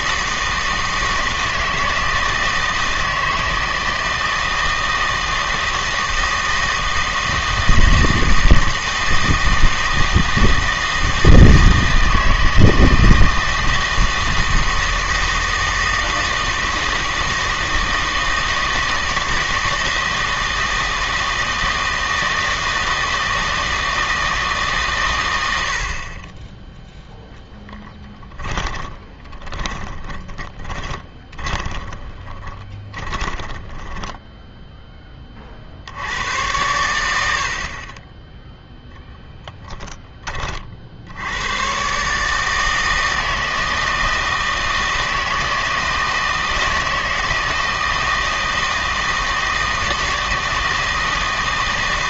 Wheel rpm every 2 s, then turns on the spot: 160, 160, 160, 160, 160, 160, 160, 160, 160, 160, 160, 160, 150, 10, 40, 30, 20, 0, 90, 0, 40, 160, 160, 160, 160, 160.
28-34